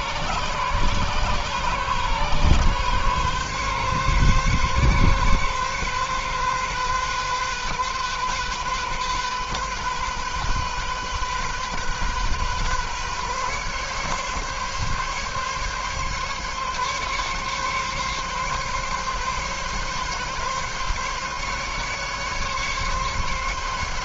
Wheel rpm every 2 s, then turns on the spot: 130, 140, 130, 130, 130, 130, 140, 140, 140, 140, 140, 140.
none